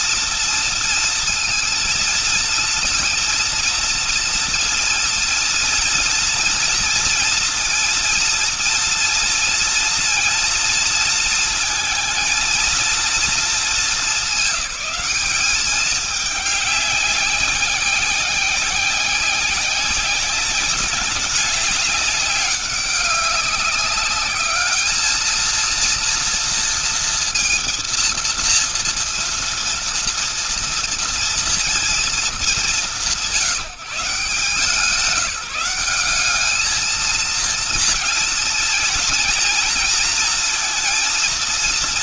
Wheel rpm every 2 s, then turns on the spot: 230, 230, 230, 240, 230, 230, 230, 210, 200, 190, 200, 200, 210, 230, 230, 230, 200, 160, 210, 230, 230.
none